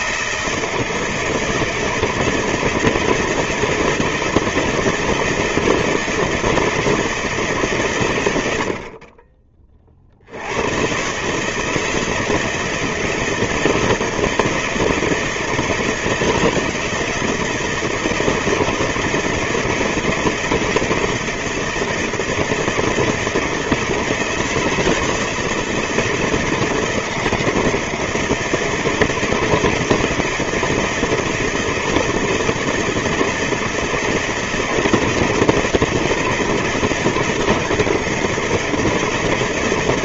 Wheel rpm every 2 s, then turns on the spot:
160, 160, 160, 170, 100, 70, 160, 160, 160, 160, 160, 160, 170, 160, 160, 170, 160, 160, 160, 160.
none